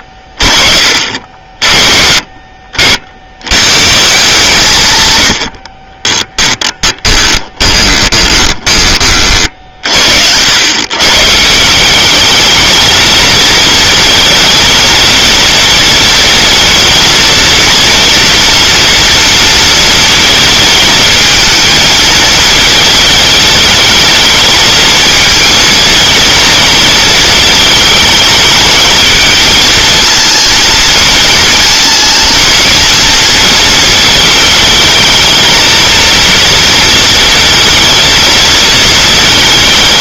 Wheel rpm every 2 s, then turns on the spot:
50, 60, 120, 10, 30, 130, 220, 230, 230, 230, 220, 220, 220, 220, 220, 230, 230, 220, 230, 220.
6-8